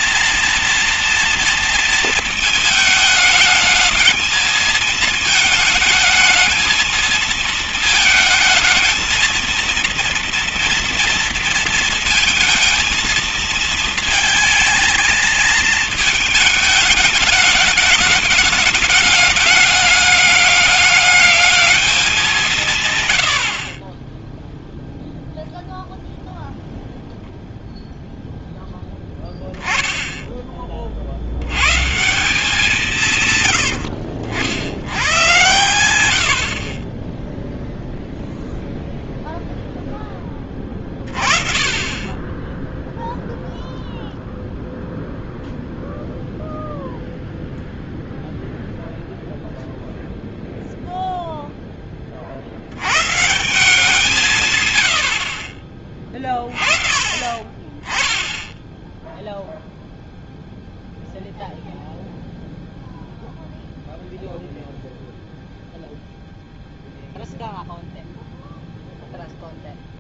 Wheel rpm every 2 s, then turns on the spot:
230, 210, 220, 220, 230, 230, 220, 230, 210, 210, 210, 60, 0, 0, 0, 20, 180, 80, 40, 0, 20, 10, 0, 0, 0, 0, 70, 130, 30, 10, 0, 0, 0, 0, 0.
none